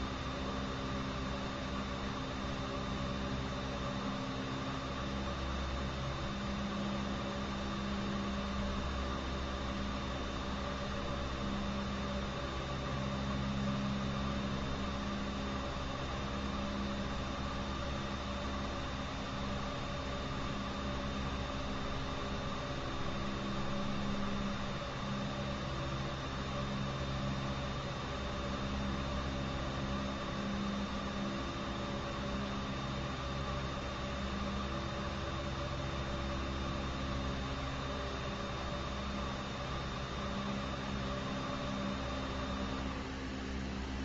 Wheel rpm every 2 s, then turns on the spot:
0, 0, 0, 0, 0, 0, 0, 0, 0, 0, 0, 0, 0, 0, 0, 0, 0, 0, 0, 0, 0, 0.
none